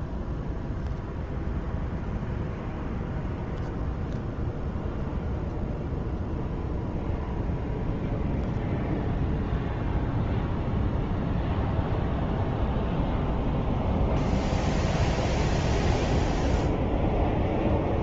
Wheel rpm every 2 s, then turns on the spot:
0, 0, 0, 0, 0, 0, 0, 0, 0.
none